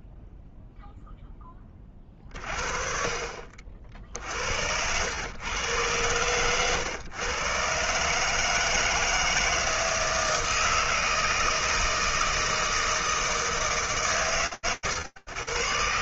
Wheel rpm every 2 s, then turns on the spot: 0, 30, 60, 110, 150, 160, 160, 130.
none